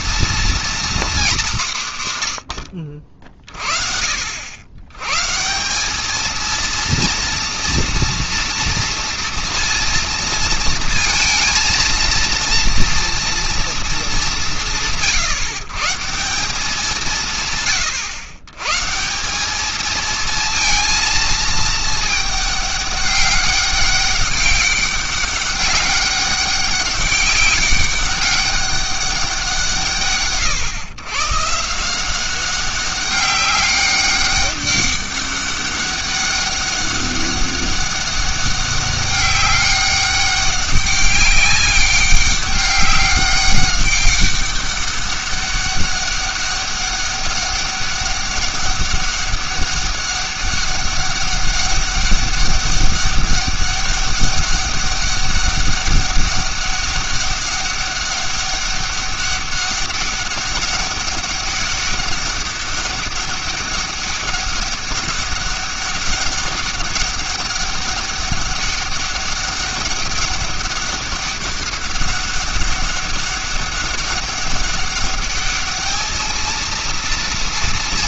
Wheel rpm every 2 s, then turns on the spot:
230, 60, 80, 230, 230, 230, 230, 170, 180, 110, 230, 210, 200, 200, 200, 130, 200, 200, 200, 200, 200, 200, 200, 200, 200, 200, 200, 200, 200, 200, 200, 200, 200, 200, 200, 200, 200, 200, 220.
none